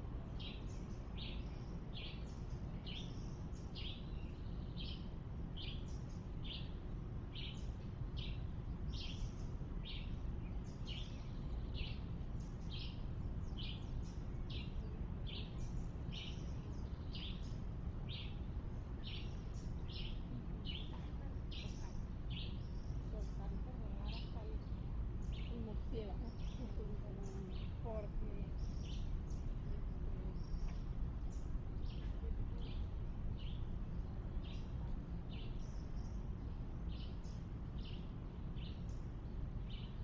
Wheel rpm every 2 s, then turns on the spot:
0, 0, 0, 0, 0, 0, 0, 0, 0, 0, 0, 0, 0, 0, 0, 0, 0, 0, 0, 0.
none